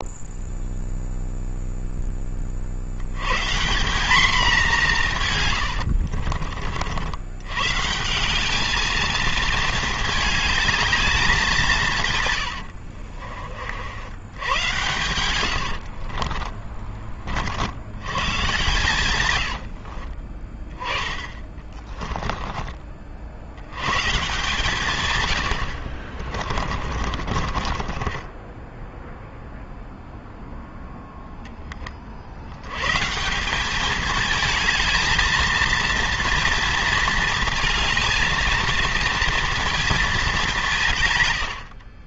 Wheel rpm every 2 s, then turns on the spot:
0, 120, 150, 90, 220, 190, 60, 100, 50, 110, 20, 70, 120, 30, 0, 10, 190, 220, 220, 230, 120.
4-6 12-16 18-22 26-28